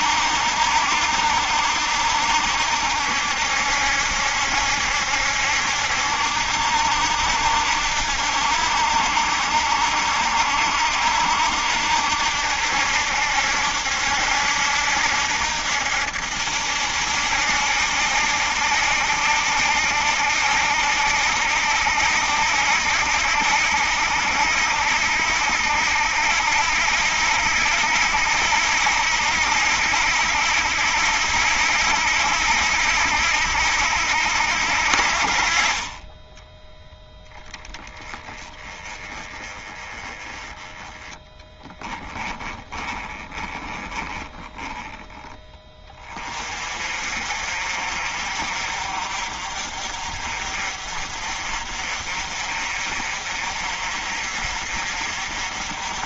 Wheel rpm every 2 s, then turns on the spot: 70, 70, 70, 70, 70, 70, 70, 70, 80, 70, 70, 70, 70, 80, 80, 80, 80, 70, 10, 20, 10, 10, 10, 40, 50, 50, 50, 50.
42-44